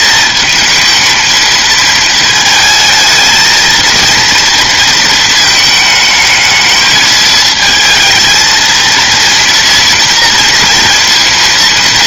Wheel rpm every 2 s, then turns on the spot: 220, 220, 230, 220, 230, 230.
none